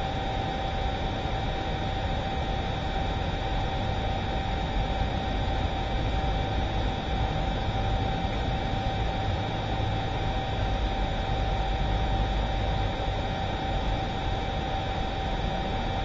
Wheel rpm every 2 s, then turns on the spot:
0, 0, 0, 0, 0, 0, 0, 0.
none